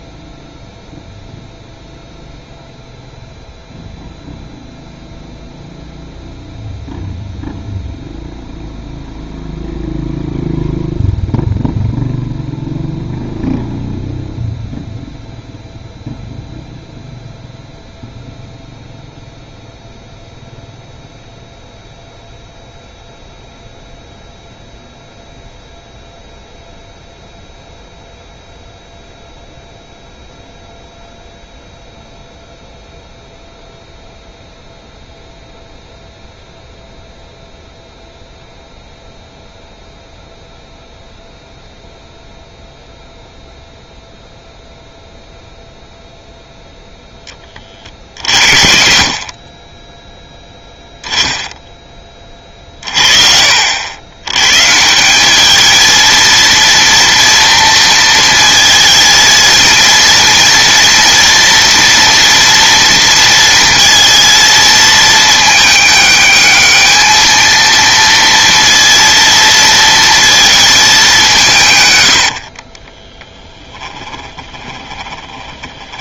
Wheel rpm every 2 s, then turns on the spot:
0, 0, 0, 0, 0, 0, 0, 0, 0, 0, 0, 0, 0, 0, 0, 0, 0, 0, 0, 0, 0, 0, 0, 10, 40, 10, 40, 150, 230, 230, 230, 230, 220, 220, 230, 210, 40, 20.
72-76